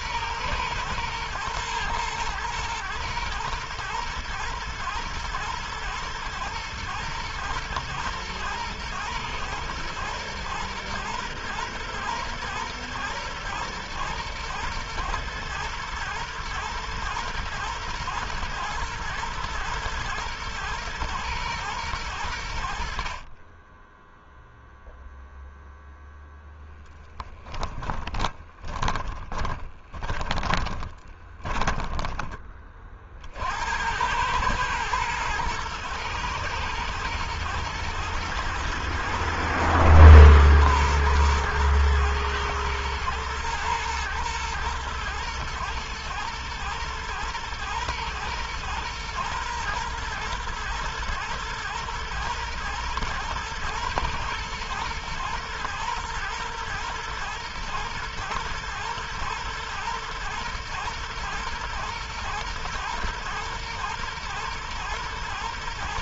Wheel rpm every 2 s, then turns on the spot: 120, 110, 110, 110, 110, 120, 110, 110, 110, 110, 110, 60, 0, 0, 10, 20, 40, 110, 110, 110, 110, 110, 110, 110, 120, 110, 120, 110, 120, 110, 110, 120, 120.
28-32